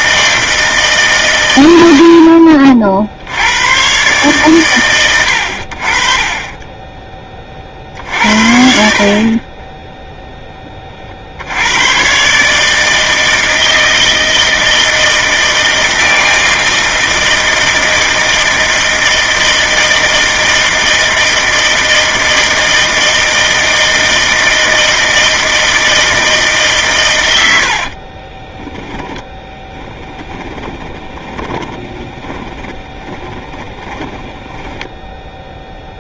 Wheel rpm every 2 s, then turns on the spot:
150, 50, 120, 20, 60, 20, 150, 160, 160, 160, 160, 160, 160, 140, 10, 20, 10, 20.
6-8 28-36